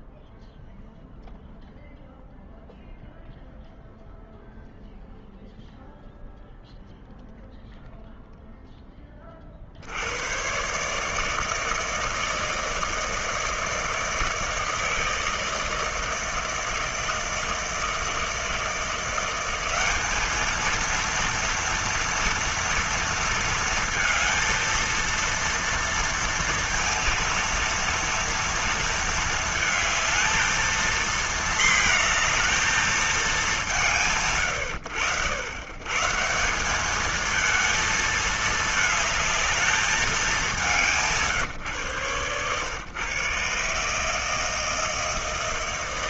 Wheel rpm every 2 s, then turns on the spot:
0, 0, 0, 0, 20, 150, 160, 160, 160, 170, 230, 230, 230, 230, 230, 230, 220, 90, 200, 220, 180, 130, 160.
none